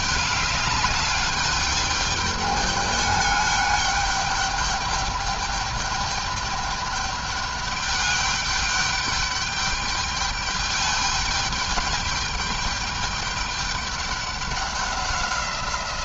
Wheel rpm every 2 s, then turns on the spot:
200, 210, 210, 210, 200, 210, 210, 190.
none